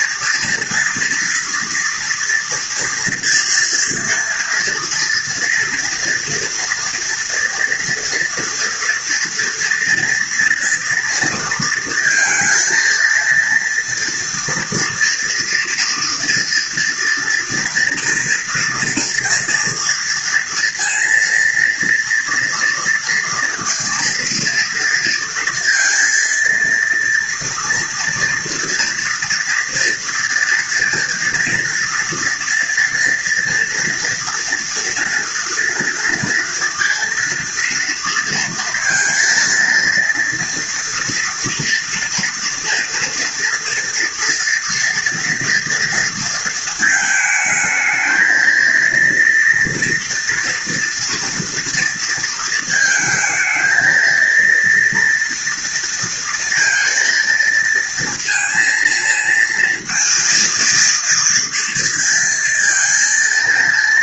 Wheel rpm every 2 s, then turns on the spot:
230, 230, 230, 230, 230, 230, 230, 230, 230, 230, 230, 230, 230, 230, 230, 230, 240, 240, 230, 230, 230, 230, 230, 220, 230, 230, 220, 230, 230, 230, 230, 230.
none